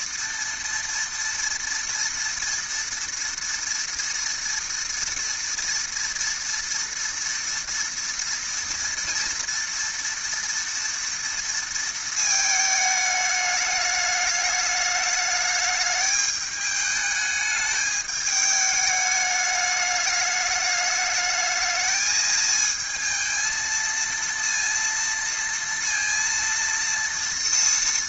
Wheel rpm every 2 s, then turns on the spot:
230, 230, 230, 230, 230, 230, 220, 210, 210, 210, 210, 220, 230, 230.
none